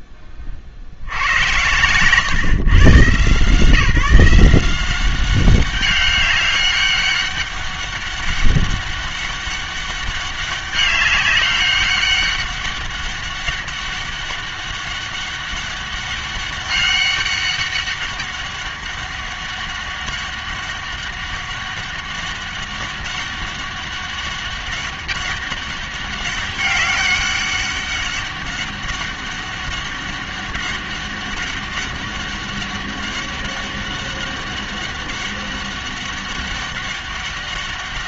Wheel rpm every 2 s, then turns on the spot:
40, 130, 170, 200, 200, 200, 200, 200, 200, 200, 200, 200, 200, 200, 200, 200, 200, 200, 200.
none